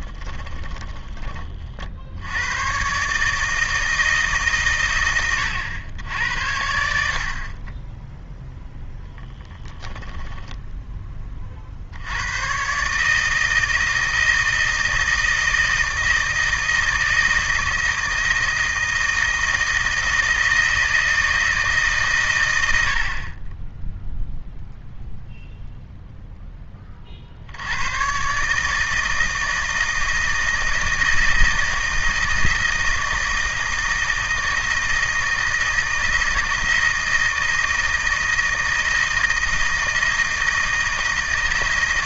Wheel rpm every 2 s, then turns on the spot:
20, 110, 140, 70, 0, 10, 130, 160, 160, 160, 160, 90, 0, 10, 150, 160, 160, 160, 160, 160, 160.
0-2